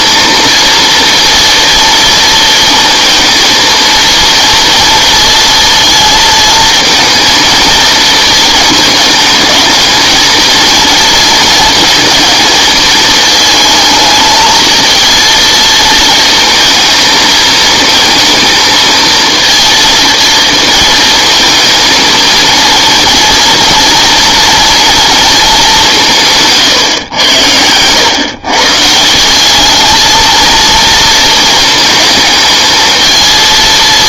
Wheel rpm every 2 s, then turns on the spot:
230, 230, 230, 220, 220, 220, 220, 220, 230, 230, 230, 230, 240, 140, 130, 230, 220.
26-28